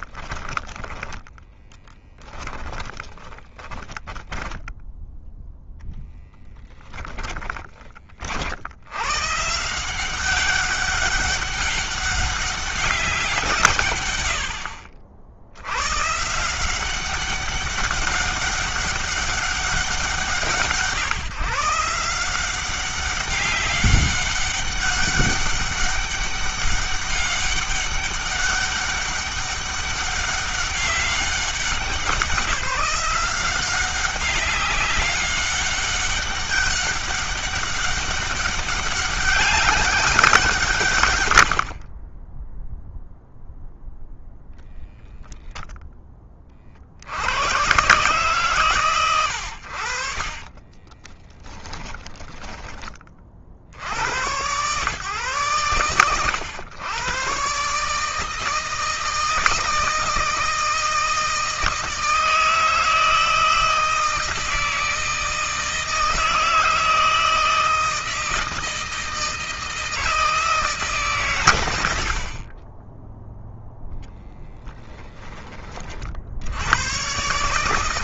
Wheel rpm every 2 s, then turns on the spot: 10, 10, 10, 10, 100, 190, 190, 70, 190, 200, 170, 190, 200, 200, 200, 200, 180, 200, 200, 200, 110, 0, 0, 50, 130, 20, 20, 120, 120, 160, 160, 160, 160, 160, 160, 140, 10, 10, 110.
0-4 6-8 50-52 74-76